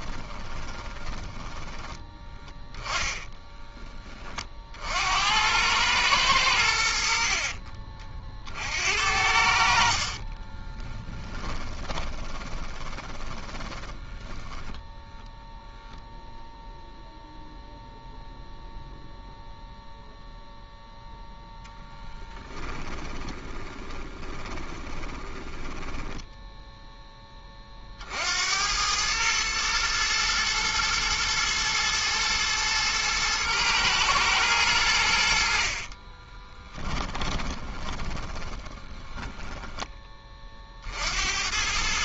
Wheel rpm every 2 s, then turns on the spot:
20, 10, 40, 90, 50, 20, 20, 10, 0, 0, 0, 10, 20, 0, 80, 110, 110, 100, 20, 10, 40.
0-2 10-14 22-26 36-40